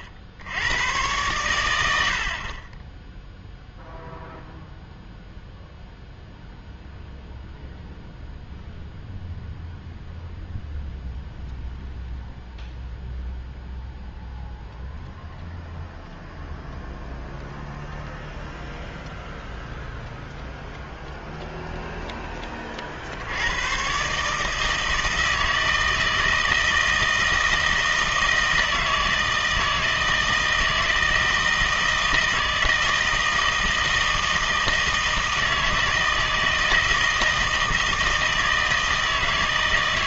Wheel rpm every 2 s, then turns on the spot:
90, 20, 0, 0, 0, 0, 0, 0, 0, 0, 0, 30, 160, 160, 160, 160, 160, 160, 160, 160.
none